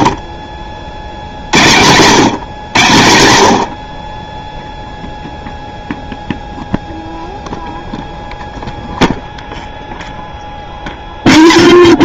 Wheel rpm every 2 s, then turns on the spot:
50, 130, 0, 0, 0, 10.
none